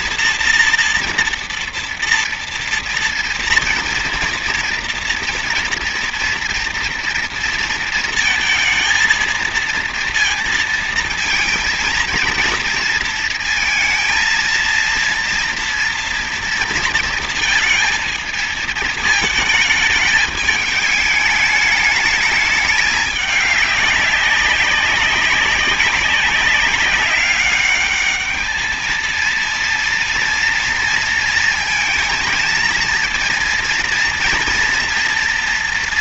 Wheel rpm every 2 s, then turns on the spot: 230, 230, 230, 230, 230, 230, 230, 230, 230, 220, 210, 210, 200, 200, 210, 230, 230, 240.
none